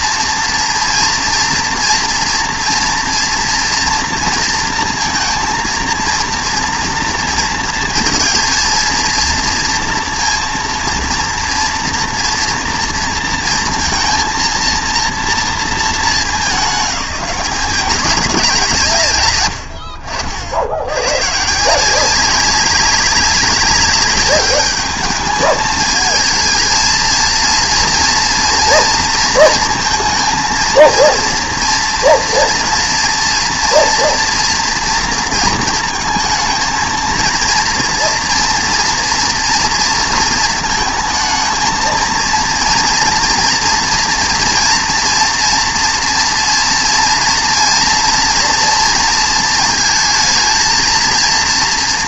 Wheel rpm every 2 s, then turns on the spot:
230, 230, 230, 230, 230, 230, 230, 230, 190, 160, 80, 190, 200, 220, 230, 230, 230, 230, 220, 230, 230, 230, 230, 230, 230, 230.
none